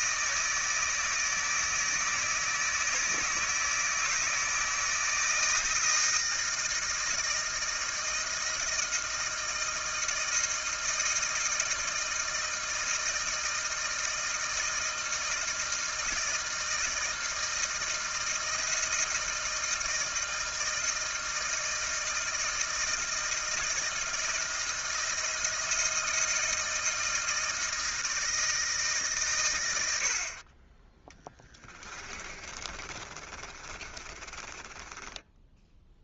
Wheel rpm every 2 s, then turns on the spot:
160, 160, 160, 160, 160, 160, 160, 160, 160, 160, 160, 160, 170, 160, 140, 10, 30, 10.
32-36